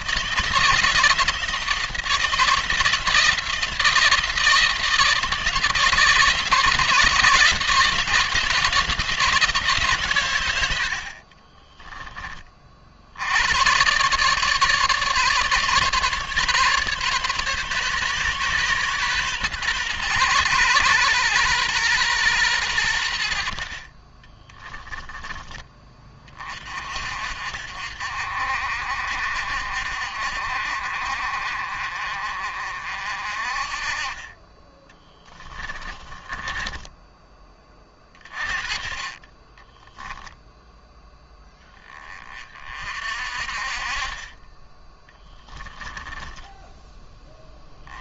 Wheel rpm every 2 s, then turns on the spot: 170, 170, 160, 160, 170, 80, 50, 150, 140, 130, 120, 100, 10, 40, 50, 50, 50, 20, 20, 30, 10, 40, 20, 10.
34-38